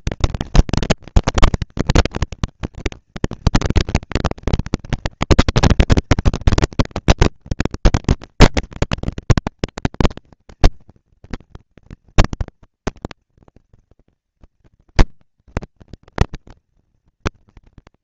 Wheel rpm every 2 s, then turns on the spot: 230, 220, 230, 230, 240, 220, 220, 210, 230.
none